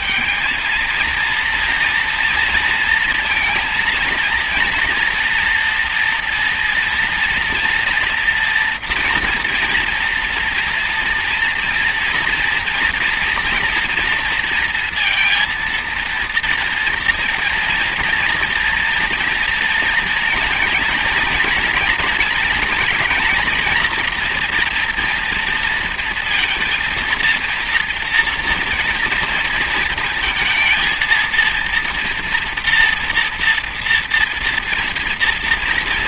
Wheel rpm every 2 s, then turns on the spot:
220, 230, 230, 230, 230, 230, 230, 230, 230, 230, 230, 230, 230, 230, 230, 220, 230, 230.
none